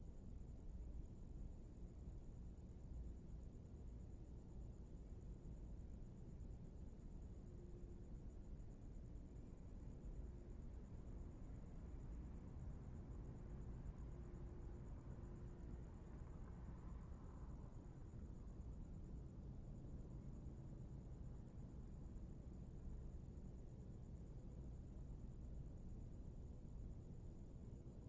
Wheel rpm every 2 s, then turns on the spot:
0, 0, 0, 0, 0, 0, 0, 0, 0, 0, 0, 0, 0, 0.
none